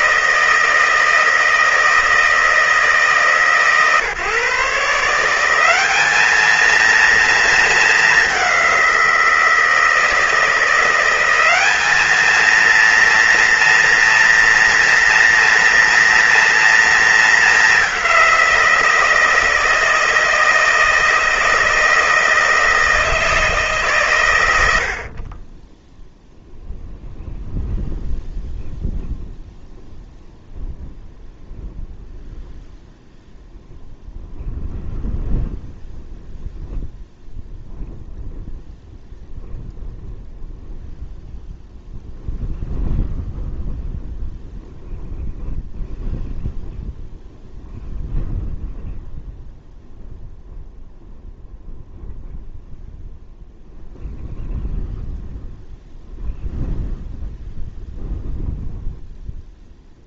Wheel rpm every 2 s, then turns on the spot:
160, 150, 150, 230, 180, 170, 230, 230, 220, 170, 160, 160, 70, 0, 0, 0, 0, 0, 0, 0, 0, 0, 0, 0, 0, 0, 0, 0, 0, 0.
none